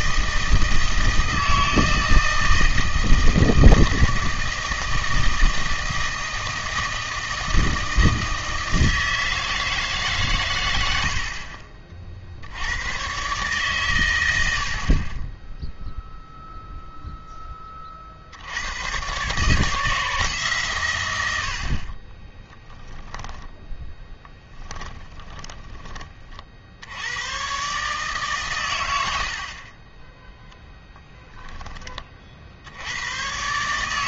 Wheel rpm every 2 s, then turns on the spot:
160, 160, 160, 160, 160, 100, 80, 70, 0, 90, 140, 20, 10, 50, 110, 10, 70.
22-26